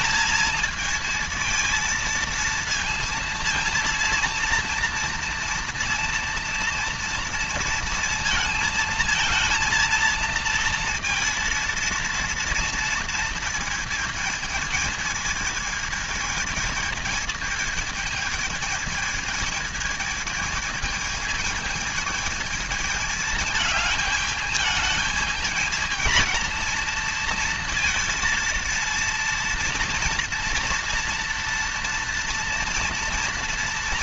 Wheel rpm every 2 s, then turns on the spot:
230, 230, 230, 230, 230, 230, 230, 220, 220, 220, 220, 220, 220, 230, 230, 230, 230.
none